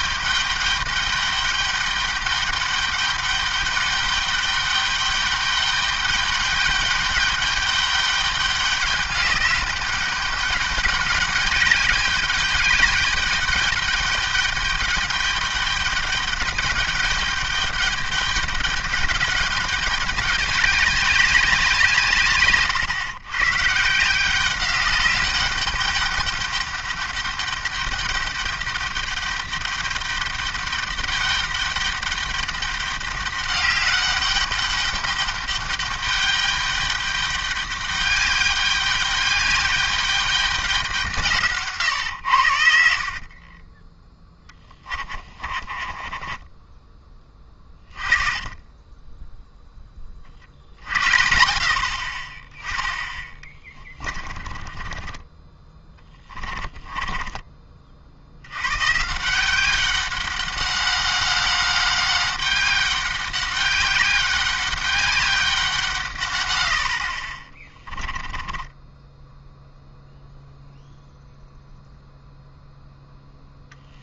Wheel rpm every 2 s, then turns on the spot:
210, 200, 200, 210, 210, 200, 200, 200, 210, 210, 200, 110, 200, 210, 200, 200, 200, 210, 200, 200, 180, 60, 20, 20, 20, 60, 20, 30, 20, 120, 200, 200, 200, 70, 10, 0, 0.
44-48 52-58 68-70